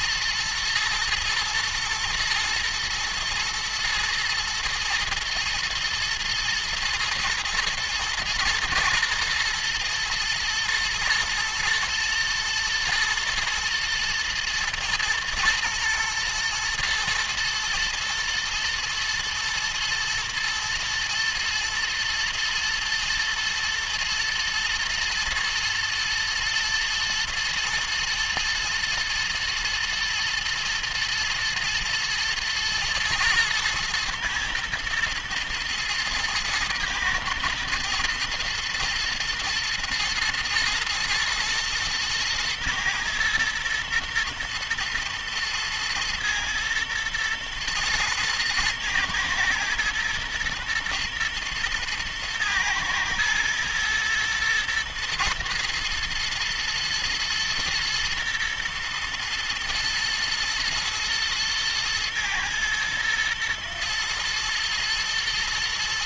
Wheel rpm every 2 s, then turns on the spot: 120, 120, 110, 120, 120, 120, 110, 110, 110, 110, 110, 110, 120, 120, 110, 110, 120, 110, 110, 110, 110, 110, 110, 110, 110, 120, 110, 120, 110, 110, 110, 120, 120.
none